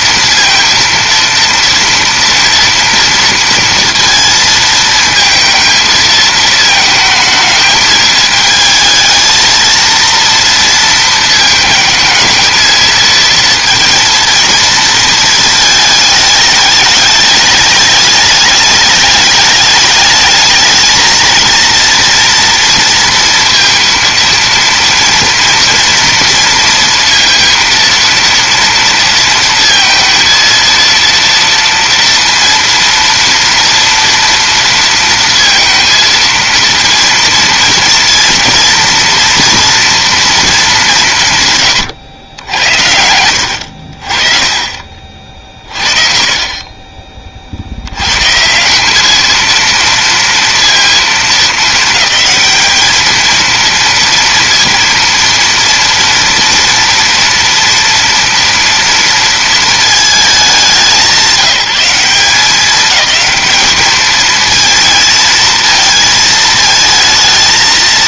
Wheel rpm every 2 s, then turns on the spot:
230, 230, 220, 220, 220, 230, 230, 230, 210, 210, 220, 230, 230, 230, 230, 230, 230, 230, 230, 230, 210, 70, 30, 30, 190, 230, 210, 230, 230, 230, 190, 210, 230, 220.
none